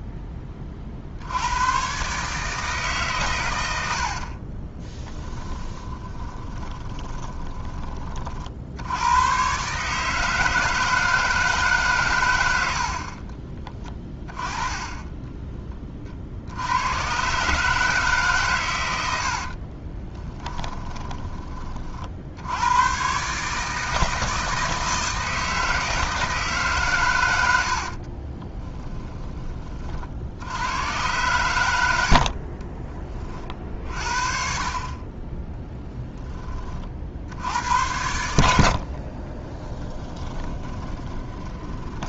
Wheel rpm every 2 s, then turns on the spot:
40, 140, 20, 20, 80, 160, 60, 20, 90, 100, 20, 110, 160, 130, 10, 100, 20, 30, 40, 60, 30.
4-8 20-22 28-30 38-42